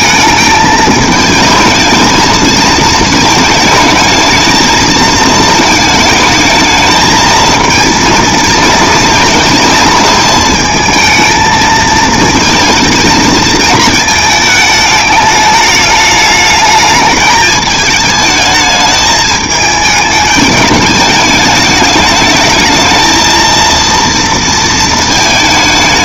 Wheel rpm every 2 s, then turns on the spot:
220, 220, 220, 220, 230, 220, 230, 220, 210, 210, 210, 220, 230.
none